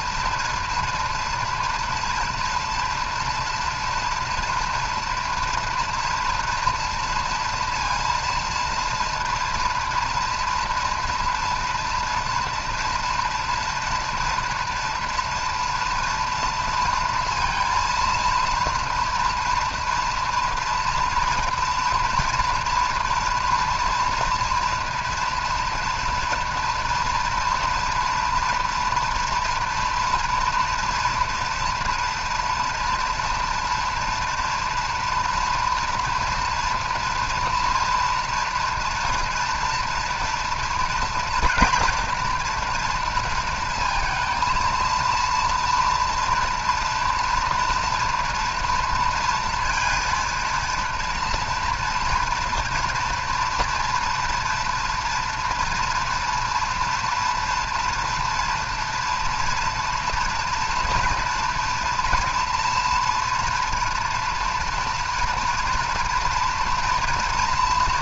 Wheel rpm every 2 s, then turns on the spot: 230, 230, 240, 230, 230, 230, 230, 230, 230, 230, 230, 230, 230, 240, 230, 230, 230, 240, 240, 230, 230, 230, 230, 230, 230, 230, 230, 230, 230, 230, 230, 240, 230, 230.
none